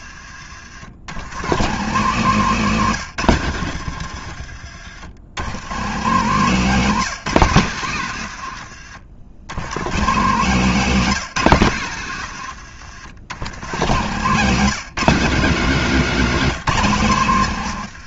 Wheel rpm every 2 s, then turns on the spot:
90, 150, 80, 190, 100, 190, 100, 190, 170.
none